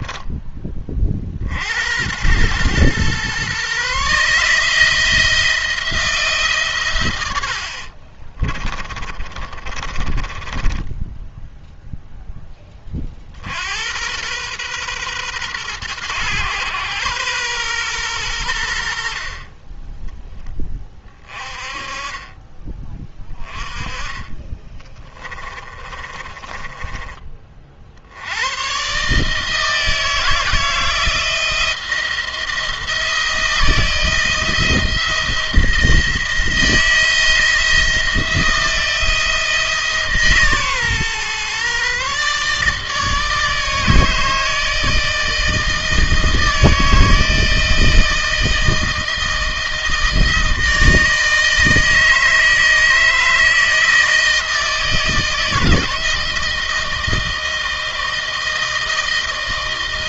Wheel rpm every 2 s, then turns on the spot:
20, 110, 150, 150, 30, 20, 20, 120, 120, 80, 20, 20, 20, 20, 110, 170, 170, 160, 160, 170, 140, 150, 160, 160, 160, 160, 160, 160, 160, 160.
8-12 24-28